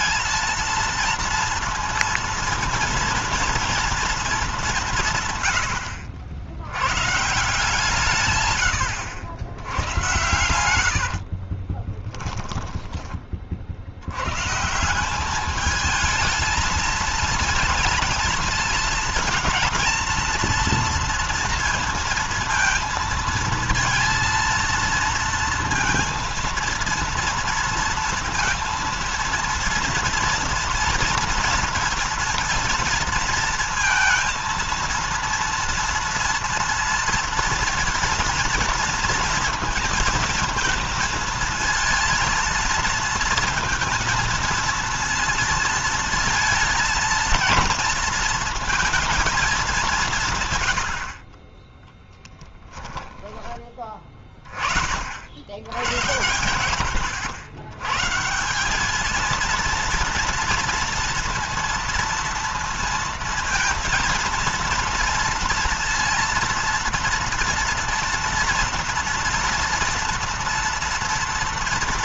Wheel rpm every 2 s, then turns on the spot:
230, 230, 200, 90, 110, 90, 10, 140, 220, 230, 230, 230, 230, 230, 230, 230, 230, 230, 230, 230, 230, 230, 230, 230, 230, 110, 10, 40, 100, 170, 230, 230, 230, 230, 230, 230.
10-14 52-54